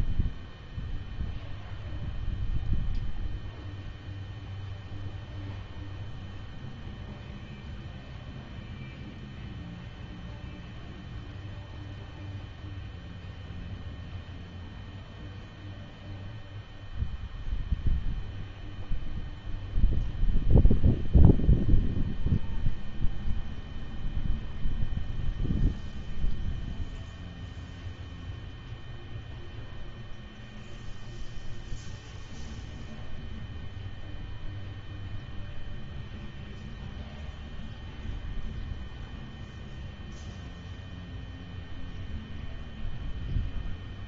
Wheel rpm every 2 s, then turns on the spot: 0, 0, 0, 0, 0, 0, 0, 0, 0, 0, 0, 0, 0, 0, 0, 0, 0, 0, 0, 0, 0, 0.
none